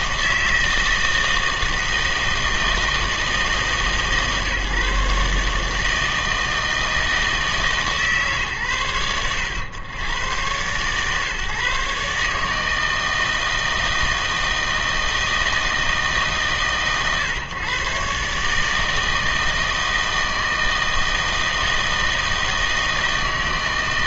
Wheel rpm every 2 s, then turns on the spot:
160, 160, 150, 160, 110, 120, 160, 160, 130, 160, 160, 160.
none